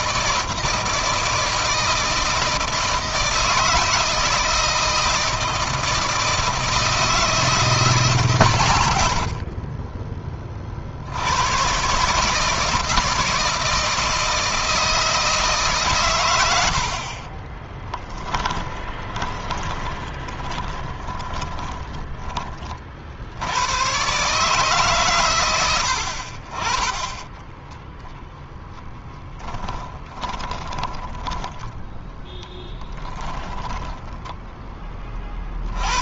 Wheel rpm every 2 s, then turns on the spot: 160, 160, 160, 160, 90, 60, 170, 160, 50, 10, 20, 50, 130, 20, 10, 20, 10, 20.
16-22 26-28 30-34